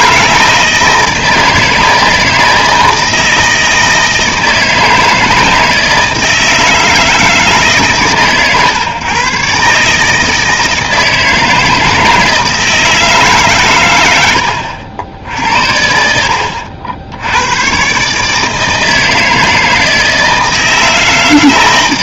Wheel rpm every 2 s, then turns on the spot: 160, 160, 160, 160, 130, 160, 160, 90, 70, 160, 160.
none